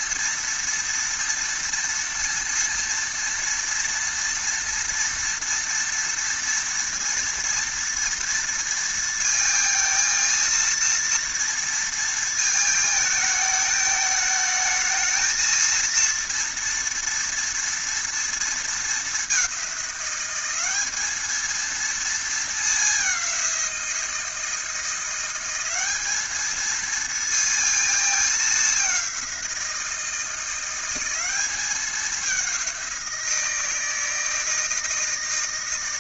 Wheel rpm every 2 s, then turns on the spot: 230, 230, 230, 230, 230, 230, 220, 220, 230, 210, 210, 200, 180, 230, 190, 190, 180, 160.
none